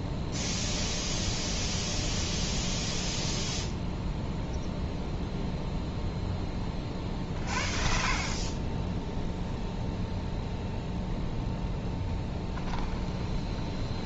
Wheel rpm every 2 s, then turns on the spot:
0, 0, 0, 30, 10, 0, 10.
12-14